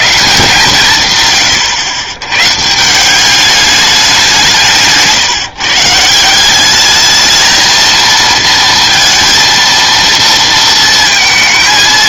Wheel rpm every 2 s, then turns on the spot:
150, 150, 170, 200, 230, 230.
none